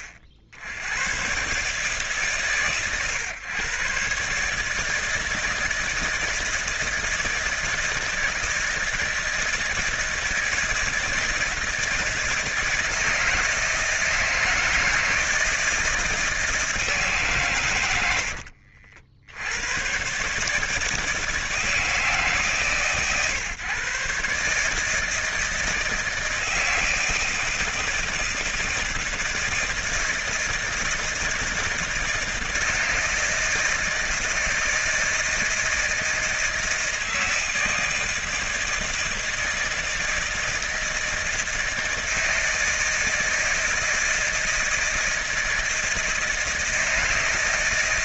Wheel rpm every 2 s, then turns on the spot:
70, 120, 150, 160, 160, 160, 160, 160, 160, 70, 150, 140, 150, 160, 160, 160, 160, 160, 160, 160, 160, 160, 160, 160.
18-20